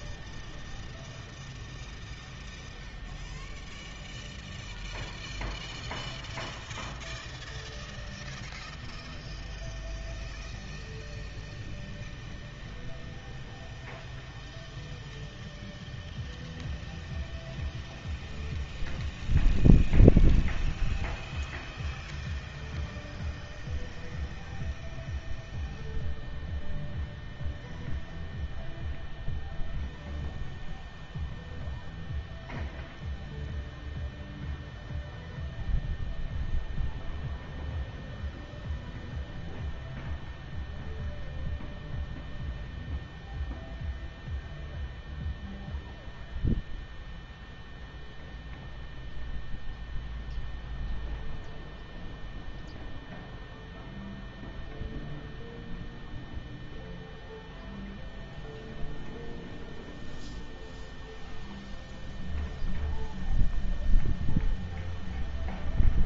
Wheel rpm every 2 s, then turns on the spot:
0, 0, 0, 0, 0, 0, 0, 0, 0, 0, 0, 0, 0, 0, 0, 0, 0, 0, 0, 0, 0, 0, 0, 0, 0, 0, 0, 0, 0, 0, 0, 0, 0.
none